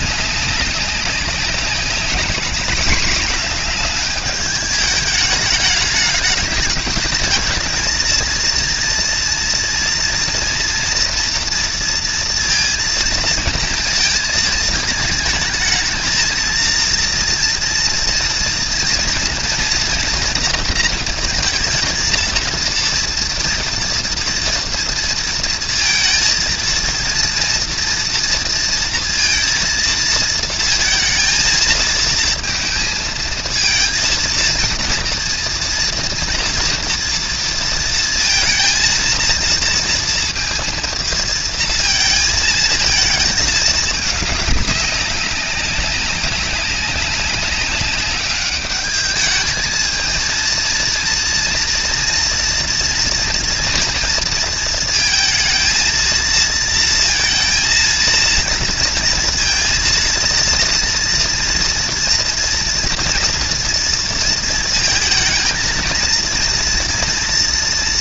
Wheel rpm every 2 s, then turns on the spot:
200, 210, 210, 210, 230, 230, 230, 220, 230, 230, 240, 230, 230, 230, 230, 220, 220, 230, 240, 230, 230, 230, 200, 200, 200, 230, 230, 230, 230, 230, 230, 240, 220, 230.
none